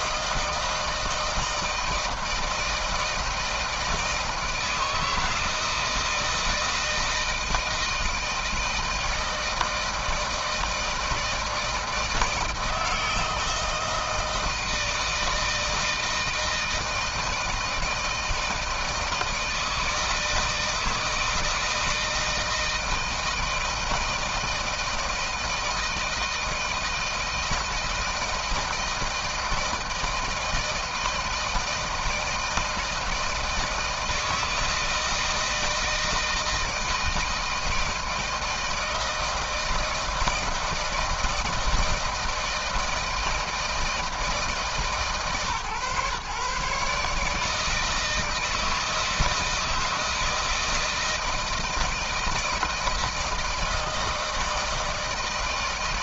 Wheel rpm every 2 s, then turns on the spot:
160, 160, 160, 160, 160, 160, 160, 160, 160, 160, 160, 160, 160, 160, 160, 160, 160, 160, 160, 170, 160, 160, 150, 150, 160, 160, 160, 160.
none